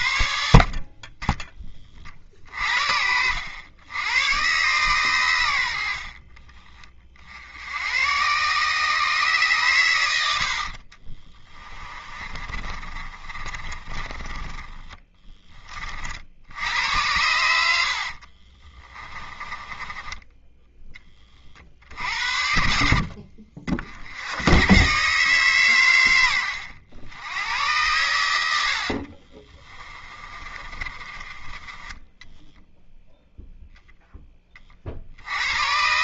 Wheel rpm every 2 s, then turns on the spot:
40, 60, 130, 30, 130, 50, 30, 10, 80, 30, 30, 70, 120, 90, 60, 30, 0, 40.
10-14 18-20 28-32